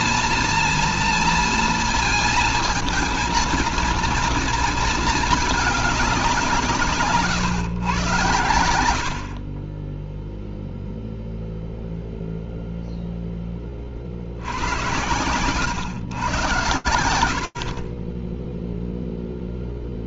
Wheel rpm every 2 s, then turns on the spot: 230, 230, 230, 160, 80, 0, 0, 90, 100, 0.
none